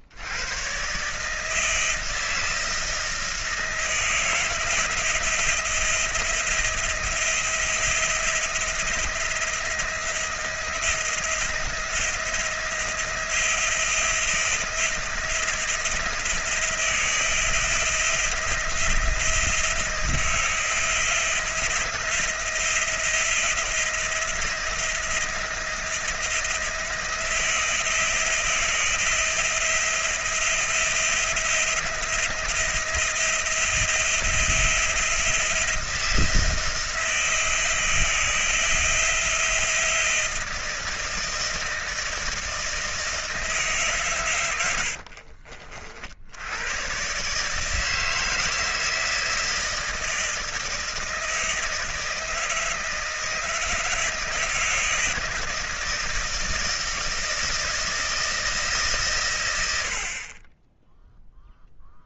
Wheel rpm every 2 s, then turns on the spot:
100, 170, 160, 170, 170, 170, 170, 170, 170, 170, 160, 170, 170, 170, 170, 170, 170, 170, 160, 160, 160, 160, 130, 60, 160, 160, 160, 160, 160, 160, 50.
none